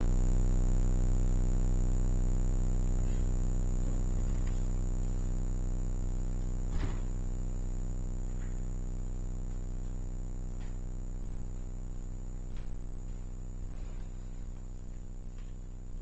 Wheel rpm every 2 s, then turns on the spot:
0, 0, 0, 0, 0, 0, 0, 0.
none